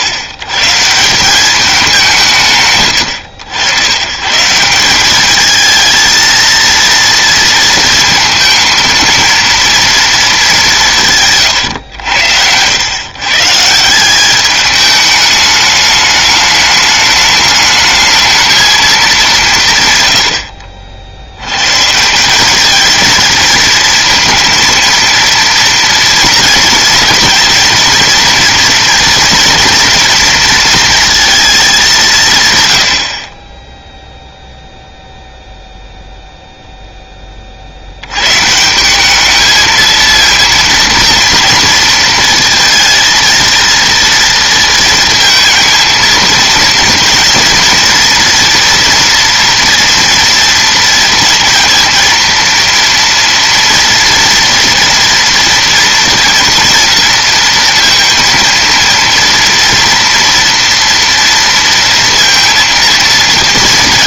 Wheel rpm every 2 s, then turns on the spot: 100, 100, 150, 230, 230, 190, 100, 210, 210, 220, 60, 210, 230, 220, 230, 230, 110, 0, 0, 150, 230, 220, 230, 230, 230, 230, 230, 230, 230, 230, 230, 230.
none